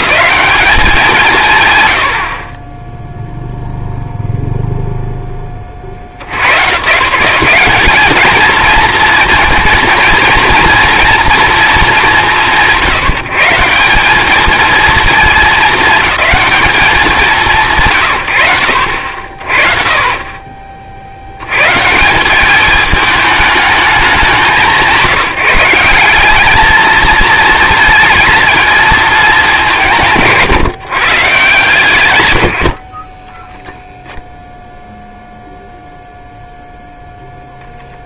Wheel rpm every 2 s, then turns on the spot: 200, 20, 0, 120, 230, 230, 130, 220, 200, 60, 50, 200, 160, 210, 220, 140, 90, 0, 0.
2-4